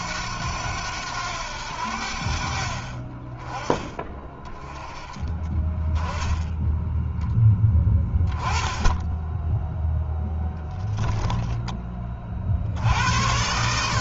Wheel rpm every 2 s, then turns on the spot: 90, 30, 20, 10, 10, 10, 80.
12-14